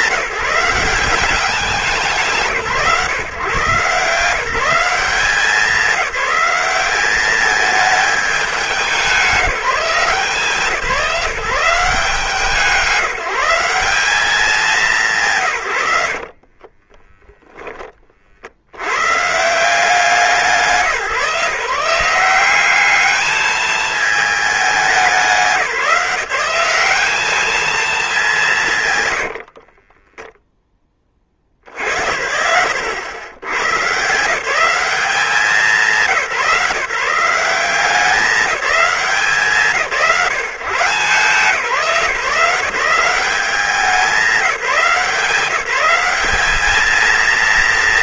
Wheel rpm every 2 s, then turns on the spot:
190, 150, 170, 190, 200, 180, 170, 210, 50, 60, 160, 190, 210, 190, 150, 10, 100, 200, 150, 200, 160, 180, 170, 210.
16-18